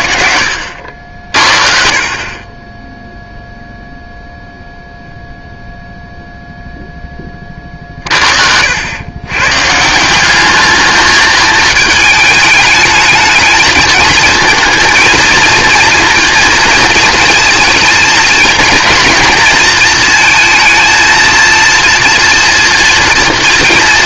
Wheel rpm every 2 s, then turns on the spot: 70, 10, 0, 0, 80, 210, 210, 230, 230, 230, 230, 230.
none